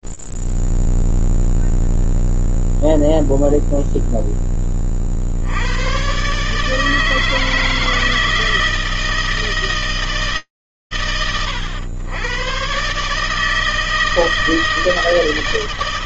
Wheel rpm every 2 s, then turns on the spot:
0, 0, 0, 60, 160, 160, 110, 160.
none